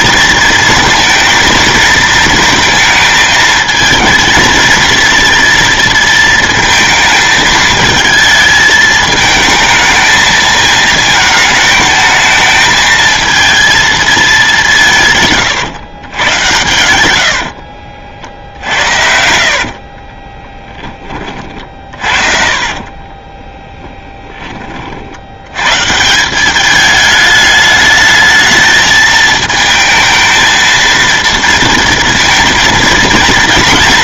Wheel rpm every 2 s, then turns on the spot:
230, 220, 230, 220, 220, 220, 220, 200, 110, 60, 20, 40, 40, 200, 220, 220, 230.
16-24